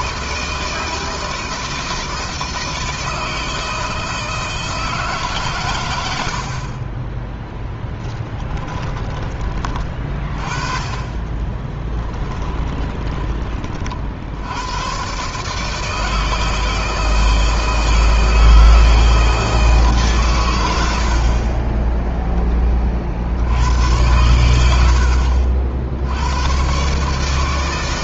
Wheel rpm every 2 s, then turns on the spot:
160, 160, 160, 50, 20, 40, 10, 80, 160, 160, 110, 20, 90, 120.
8-10 12-14